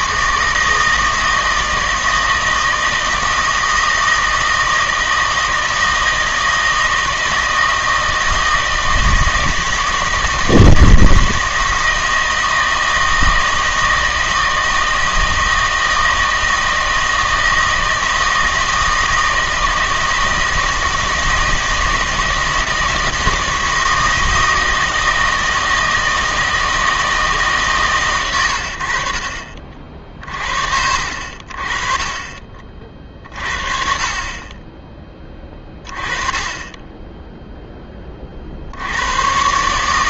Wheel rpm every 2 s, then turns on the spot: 160, 160, 160, 160, 160, 160, 160, 160, 160, 160, 160, 160, 160, 160, 100, 50, 30, 20, 20, 70.
none